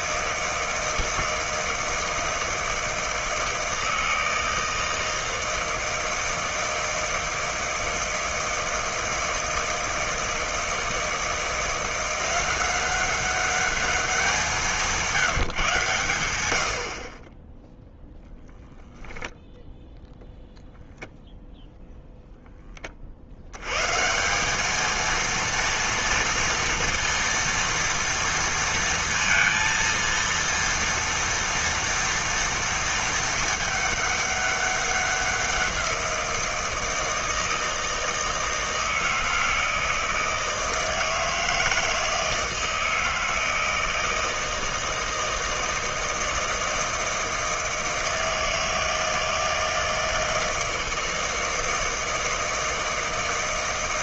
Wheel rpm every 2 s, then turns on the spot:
160, 160, 160, 160, 160, 160, 190, 180, 70, 10, 0, 30, 220, 230, 230, 230, 230, 200, 160, 160, 160, 160, 160, 160, 160, 160, 160.
none